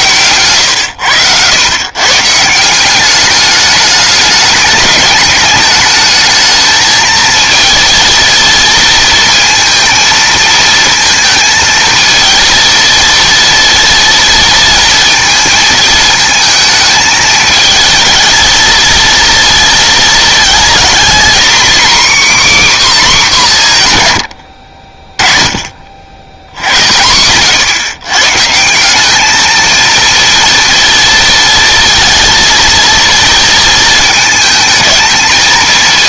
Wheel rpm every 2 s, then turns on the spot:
100, 170, 210, 220, 230, 230, 230, 230, 220, 220, 240, 280, 60, 90, 160, 230, 230, 220.
none